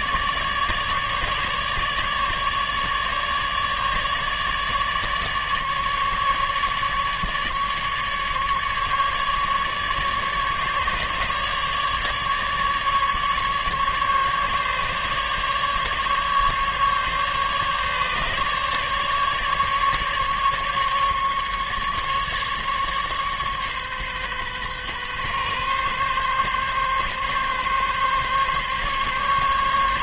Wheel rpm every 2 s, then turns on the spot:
150, 150, 150, 150, 150, 150, 150, 150, 150, 150, 140, 140, 130, 140, 140.
none